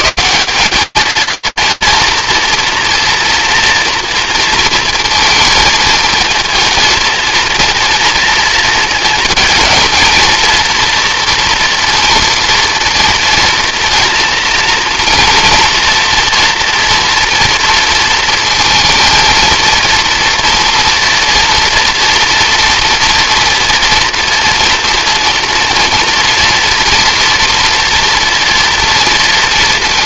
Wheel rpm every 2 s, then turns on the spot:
220, 240, 230, 220, 230, 230, 230, 230, 230, 230, 230, 230, 230, 230, 230.
none